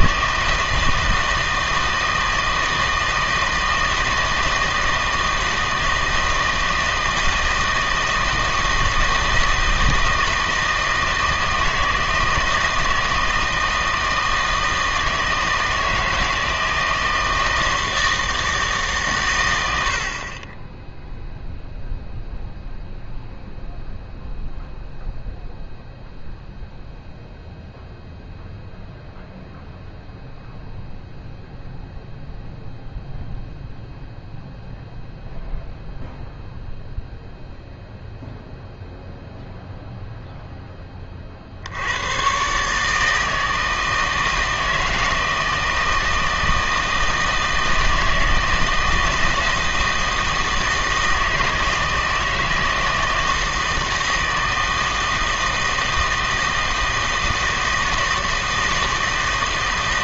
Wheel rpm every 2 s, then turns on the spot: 160, 160, 160, 160, 160, 160, 160, 160, 160, 150, 10, 0, 0, 0, 0, 0, 0, 0, 0, 0, 10, 150, 160, 160, 160, 160, 160, 160, 160, 160.
none